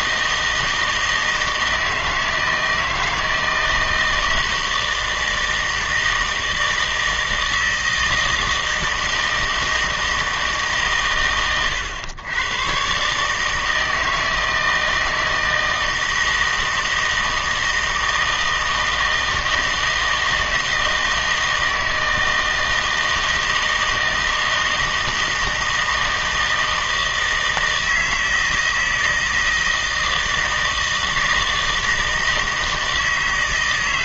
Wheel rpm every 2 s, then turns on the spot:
160, 160, 160, 160, 160, 140, 130, 160, 160, 160, 160, 160, 160, 160, 160, 160, 160.
none